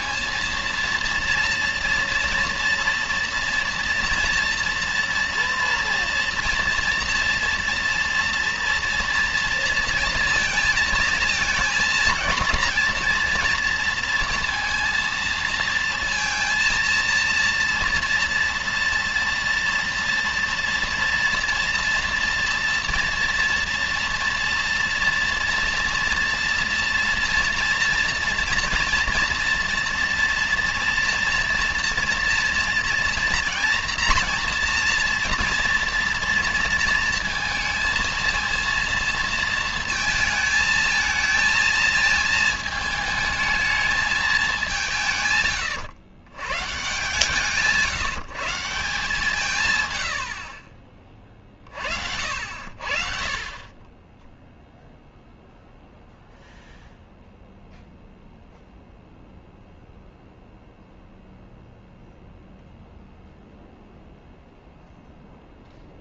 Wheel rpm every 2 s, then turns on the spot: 230, 230, 240, 230, 230, 220, 230, 230, 230, 230, 230, 230, 230, 230, 230, 230, 230, 230, 230, 230, 220, 220, 200, 130, 150, 50, 60, 0, 0, 0, 0, 0, 0.
none